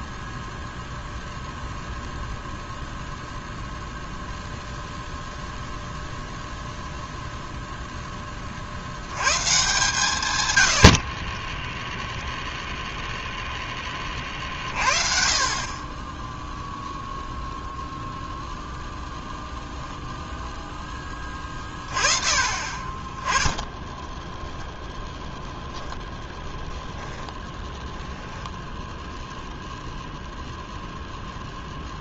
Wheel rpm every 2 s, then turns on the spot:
0, 0, 0, 0, 40, 100, 0, 40, 0, 0, 0, 30, 0, 10, 0, 0.
26-28